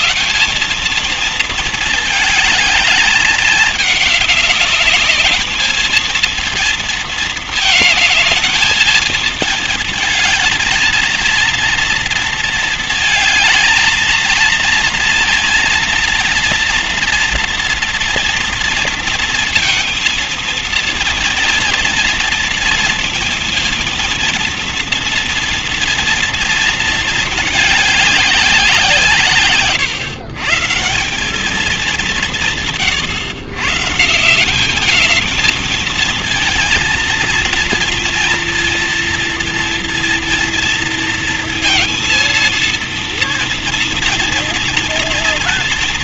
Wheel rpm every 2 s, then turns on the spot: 220, 210, 200, 230, 220, 220, 220, 230, 230, 230, 230, 230, 230, 230, 180, 170, 140, 200, 230, 240, 230, 230, 230.
none